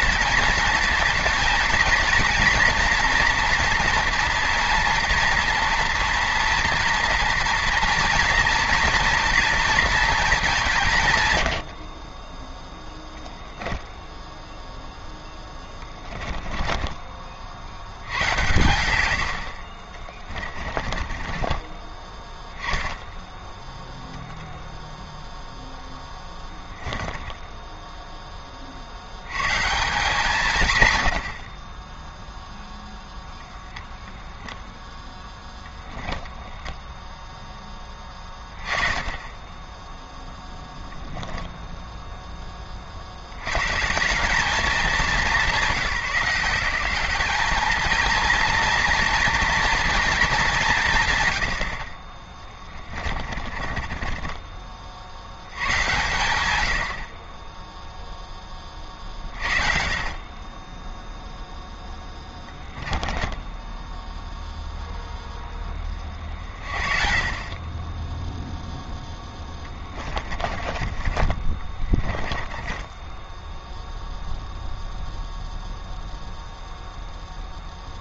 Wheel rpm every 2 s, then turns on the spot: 230, 230, 240, 230, 230, 140, 0, 0, 20, 120, 30, 10, 10, 10, 70, 110, 10, 0, 0, 20, 0, 40, 190, 190, 230, 140, 20, 30, 70, 40, 10, 10, 0, 40, 0, 20, 10, 0, 0.
16-18 20-22 24-28 52-54 62-64 70-74